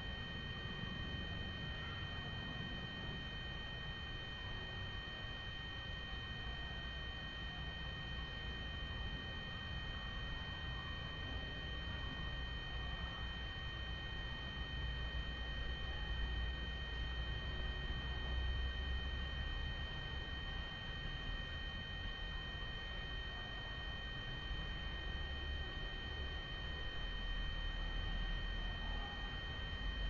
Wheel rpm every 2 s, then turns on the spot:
0, 0, 0, 0, 0, 0, 0, 0, 0, 0, 0, 0, 0, 0, 0.
none